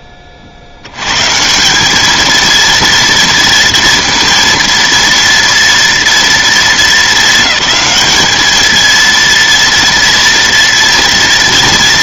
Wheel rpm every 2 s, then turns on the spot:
70, 230, 230, 220, 230, 230.
none